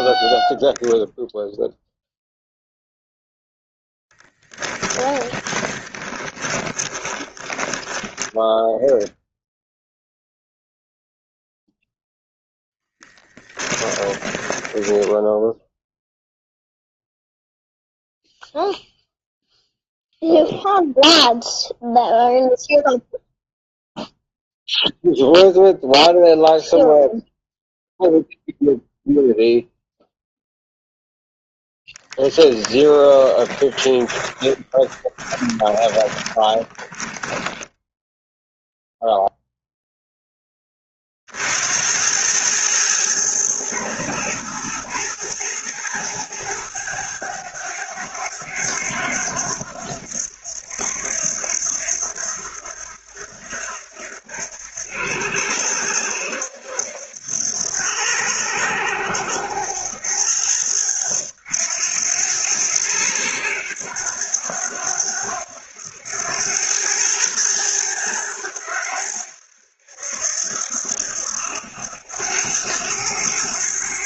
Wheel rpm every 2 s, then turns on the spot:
0, 0, 10, 20, 0, 0, 10, 10, 0, 0, 0, 0, 0, 0, 0, 0, 20, 20, 20, 0, 30, 110, 110, 110, 90, 80, 80, 80, 80, 90, 90, 90, 90, 110, 90, 80, 100.
4-8 12-16 32-38